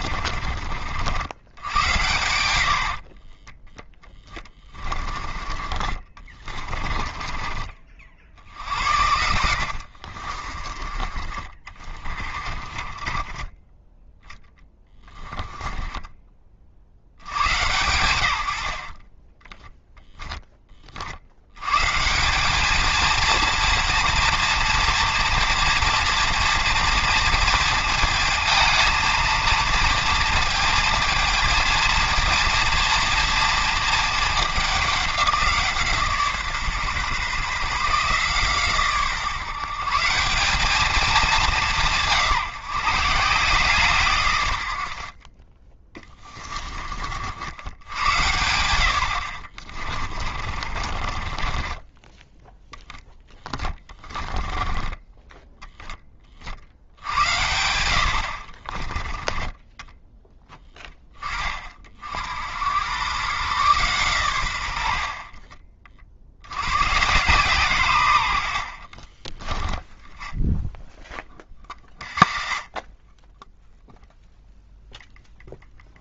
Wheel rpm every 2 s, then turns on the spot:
60, 60, 20, 30, 80, 30, 30, 10, 50, 60, 30, 220, 240, 230, 220, 220, 230, 200, 140, 140, 210, 170, 70, 30, 110, 40, 10, 10, 70, 30, 10, 100, 80, 110, 60, 10, 30, 0.
2-4 6-8 10-16 18-20 50-52 54-56 58-60 68-70 72-74